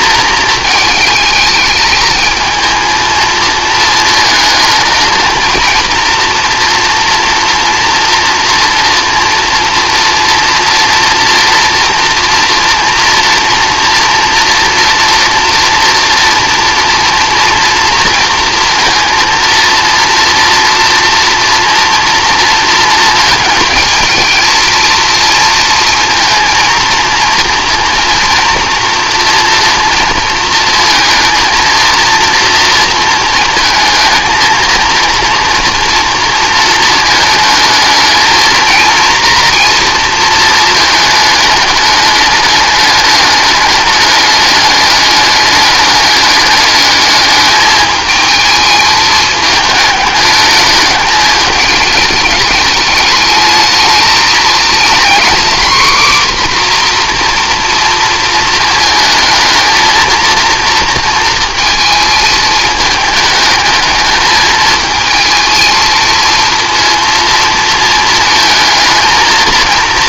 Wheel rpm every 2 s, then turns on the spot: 220, 220, 220, 240, 230, 230, 230, 230, 230, 230, 230, 230, 230, 230, 240, 230, 230, 220, 230, 220, 230, 210, 210, 210, 220, 210, 210, 220, 250, 230, 230, 220, 220, 230, 220.
none